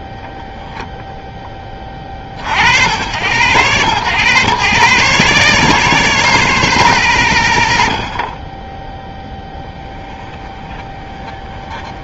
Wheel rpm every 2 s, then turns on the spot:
0, 50, 130, 160, 10, 20.
10-12